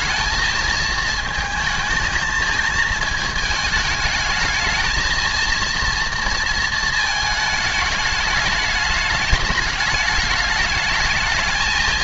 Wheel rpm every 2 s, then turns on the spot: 220, 220, 220, 230, 210, 210.
none